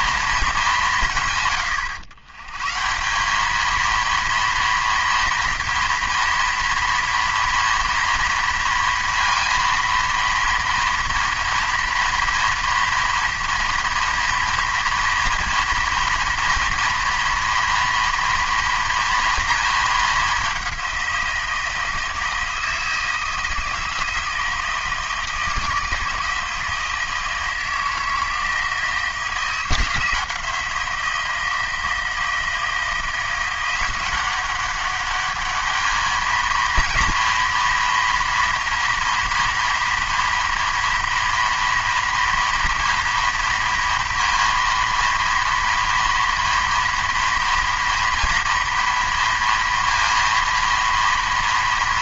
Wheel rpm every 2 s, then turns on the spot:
190, 150, 230, 230, 230, 230, 230, 230, 230, 230, 190, 160, 160, 160, 160, 170, 170, 190, 230, 230, 230, 230, 230, 230, 230, 230.
none